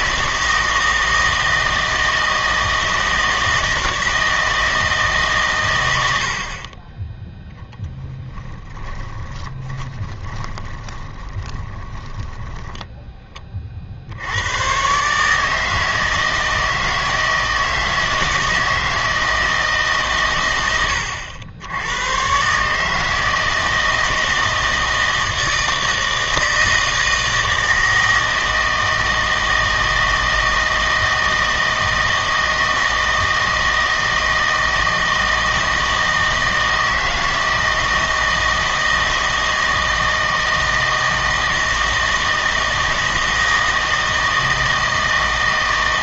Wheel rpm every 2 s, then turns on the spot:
160, 160, 160, 40, 10, 20, 10, 110, 160, 160, 110, 140, 160, 160, 160, 160, 160, 160, 160, 160, 160, 160, 160.
8-14